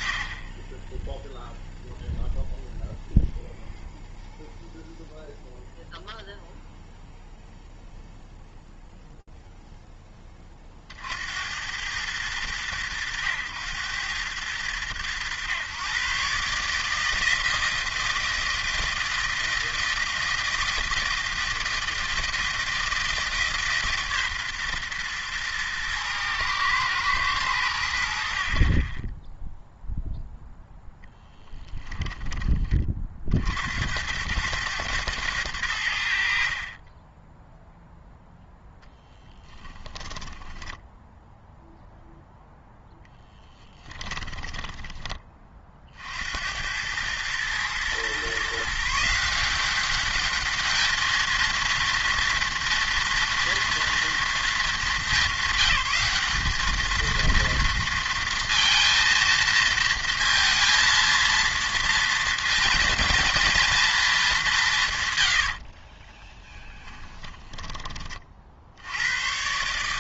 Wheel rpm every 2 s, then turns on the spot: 20, 0, 0, 0, 0, 50, 100, 100, 160, 160, 160, 160, 120, 110, 30, 0, 20, 110, 40, 0, 10, 0, 10, 80, 150, 210, 230, 220, 210, 230, 230, 230, 160, 10, 60.
40-42 44-46 66-68